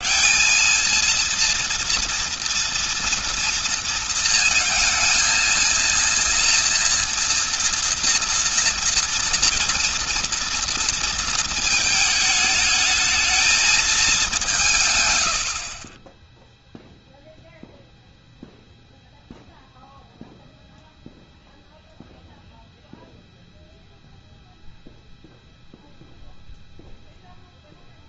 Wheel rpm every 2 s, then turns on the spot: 220, 230, 230, 230, 240, 230, 220, 150, 0, 0, 0, 0, 0, 0.
none